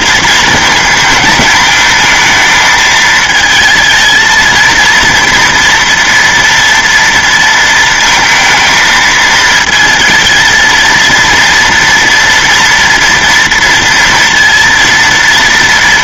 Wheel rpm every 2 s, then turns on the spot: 230, 220, 230, 230, 230, 230, 230, 230.
none